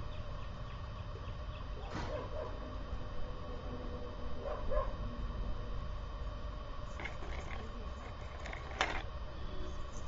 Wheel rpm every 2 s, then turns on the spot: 0, 0, 0, 0, 0.
none